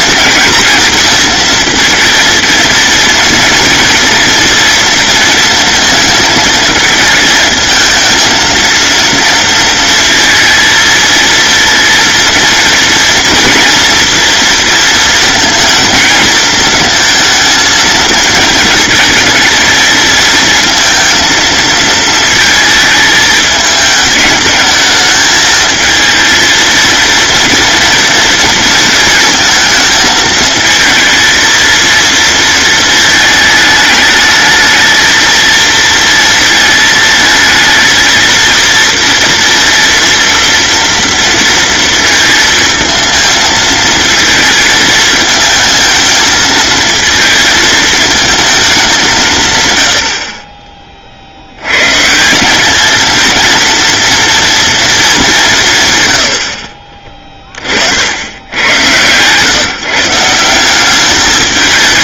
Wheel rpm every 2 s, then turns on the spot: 230, 230, 230, 220, 230, 230, 230, 230, 220, 220, 230, 220, 220, 220, 230, 220, 230, 220, 220, 230, 230, 230, 220, 220, 210, 40, 200, 230, 60, 100, 190.
56-58